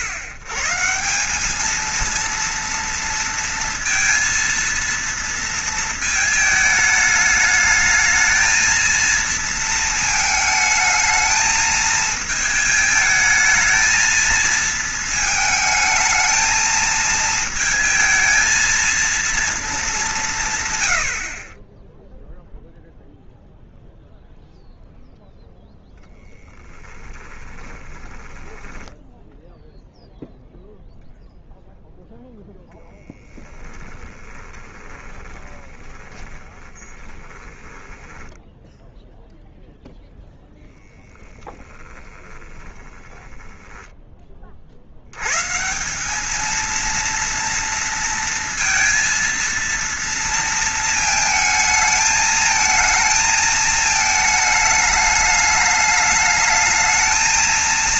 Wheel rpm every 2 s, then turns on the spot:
120, 230, 230, 220, 230, 220, 220, 230, 220, 220, 140, 0, 0, 10, 10, 0, 0, 20, 20, 10, 0, 20, 40, 230, 230, 230, 220, 220, 220.
28-30 34-40 42-44